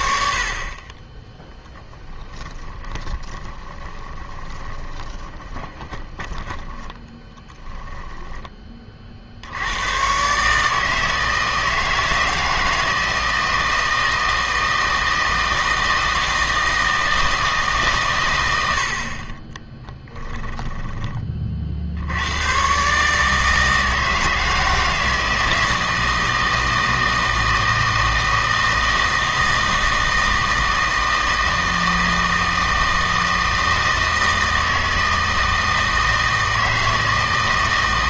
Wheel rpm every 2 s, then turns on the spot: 30, 20, 20, 10, 20, 150, 160, 160, 160, 70, 10, 130, 160, 160, 160, 160, 160, 160, 160.
2-8 20-22